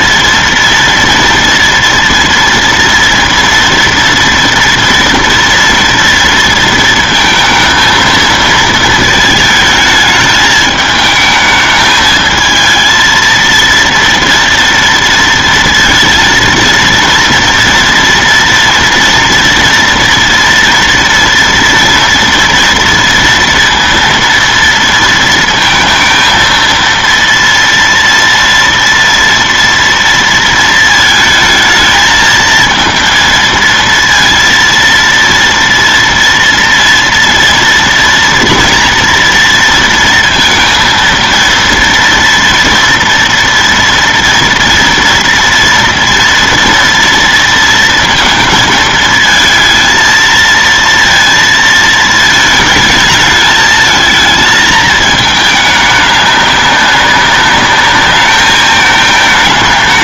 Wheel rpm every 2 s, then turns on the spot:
230, 230, 230, 230, 230, 210, 220, 230, 230, 240, 240, 230, 230, 230, 230, 230, 220, 230, 230, 230, 230, 230, 230, 230, 230, 230, 220, 220, 200, 210.
none